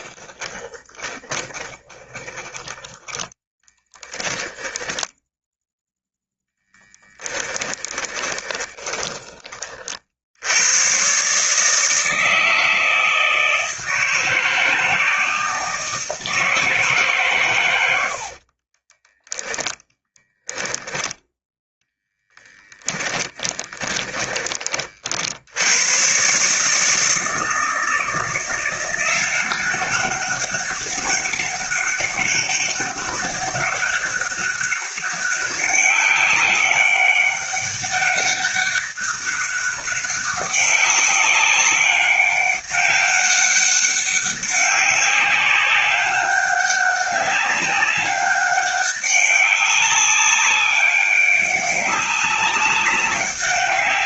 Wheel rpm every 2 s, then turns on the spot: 20, 10, 10, 10, 20, 110, 160, 160, 160, 30, 0, 10, 40, 150, 180, 200, 190, 190, 190, 200, 200, 200, 200, 200, 200, 200, 200.
0-2 4-6 8-10 18-20 22-24